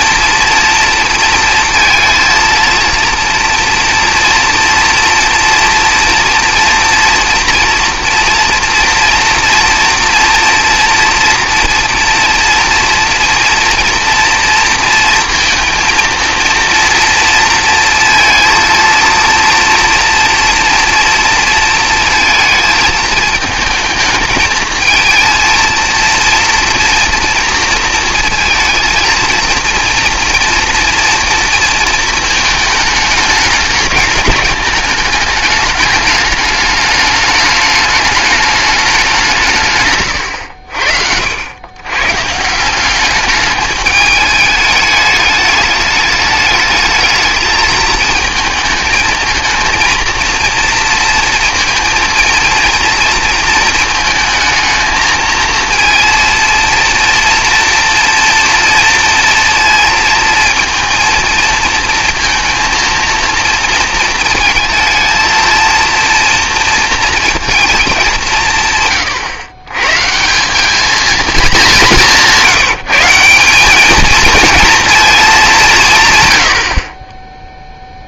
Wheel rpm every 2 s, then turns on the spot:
230, 230, 230, 230, 240, 230, 240, 230, 230, 230, 230, 220, 220, 230, 230, 240, 220, 220, 210, 210, 80, 170, 210, 220, 220, 230, 230, 220, 230, 230, 230, 230, 220, 230, 150, 200, 170, 230, 60.
none